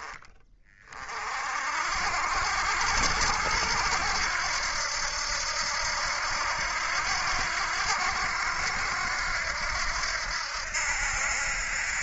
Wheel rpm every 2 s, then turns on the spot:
30, 70, 80, 80, 80, 80.
none